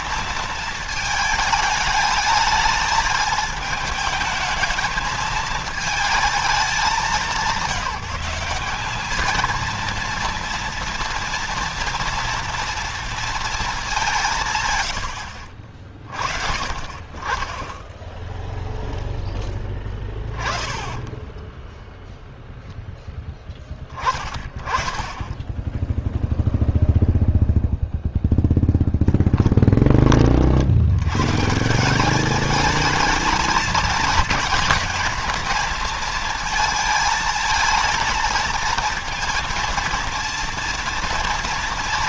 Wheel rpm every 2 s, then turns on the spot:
230, 220, 220, 210, 200, 230, 230, 150, 50, 0, 20, 0, 30, 0, 0, 60, 210, 230, 230, 230, 230.
none